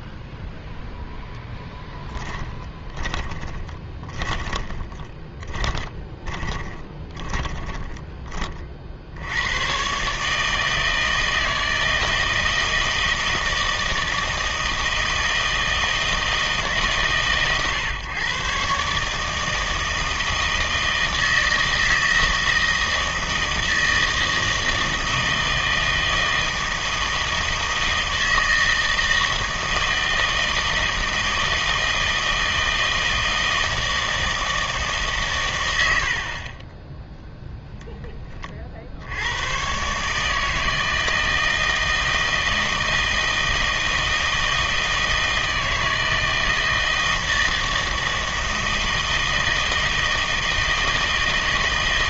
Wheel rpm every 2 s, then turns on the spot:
0, 20, 20, 20, 50, 160, 160, 160, 140, 140, 160, 160, 160, 160, 160, 160, 160, 160, 20, 50, 160, 160, 160, 160, 160, 160.
2-8